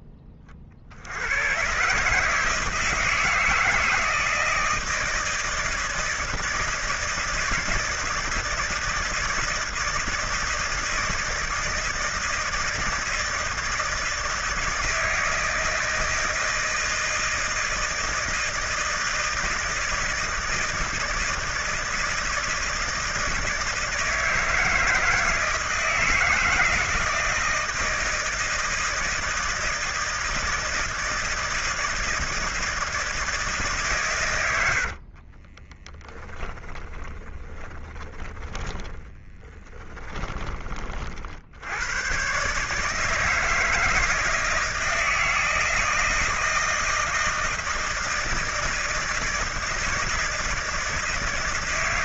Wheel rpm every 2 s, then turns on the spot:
30, 160, 160, 160, 160, 160, 160, 160, 160, 160, 160, 160, 160, 160, 160, 160, 160, 90, 20, 20, 30, 140, 160, 160, 160, 160.
34-40